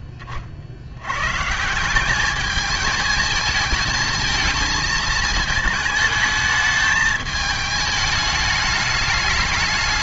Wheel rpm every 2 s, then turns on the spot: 60, 220, 220, 210, 210.
none